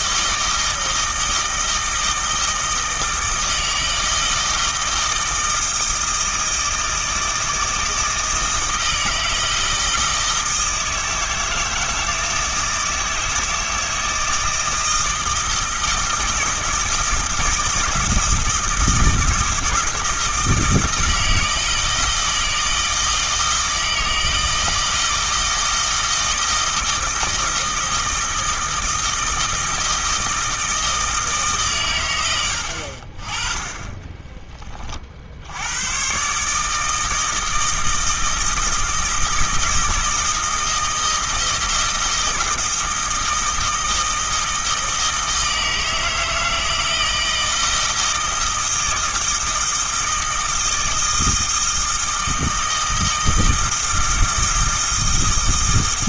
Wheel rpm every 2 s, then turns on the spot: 160, 160, 160, 160, 160, 160, 160, 160, 160, 160, 160, 160, 160, 160, 160, 160, 70, 30, 160, 160, 160, 160, 160, 160, 160, 160, 160, 160.
none